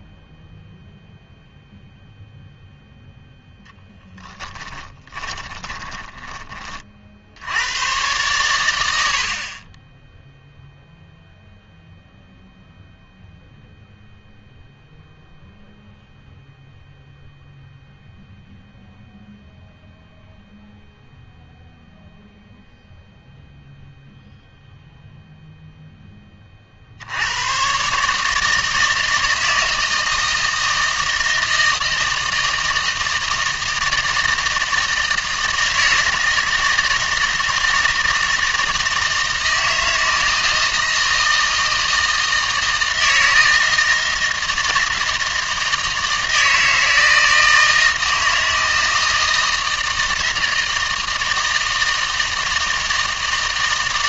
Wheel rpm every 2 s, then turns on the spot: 0, 0, 20, 30, 90, 0, 0, 0, 0, 0, 0, 0, 0, 50, 160, 160, 160, 160, 160, 160, 160, 160, 160, 160, 160, 160, 160.
4-6